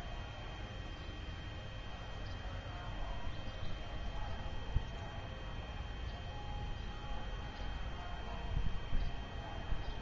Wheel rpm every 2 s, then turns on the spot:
0, 0, 0, 0, 0.
none